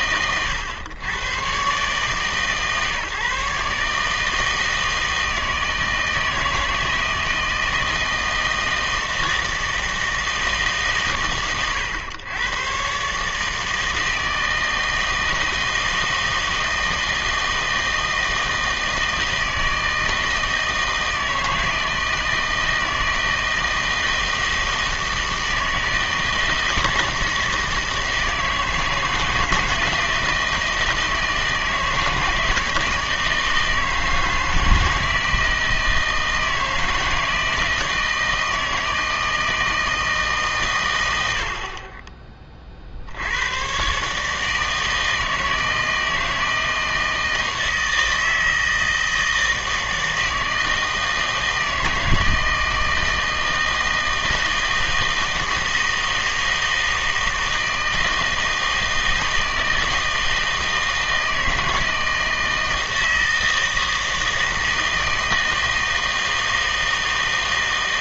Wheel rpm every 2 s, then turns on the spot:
110, 140, 160, 160, 160, 150, 120, 160, 160, 160, 160, 160, 160, 160, 160, 160, 160, 160, 160, 160, 130, 50, 160, 160, 160, 160, 160, 160, 160, 160, 160, 160, 160, 160.
none